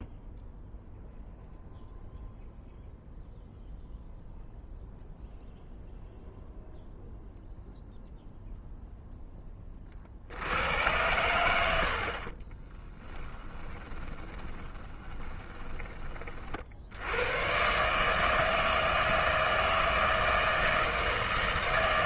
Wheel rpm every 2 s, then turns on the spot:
0, 0, 0, 0, 0, 80, 30, 20, 50, 160, 160.
12-16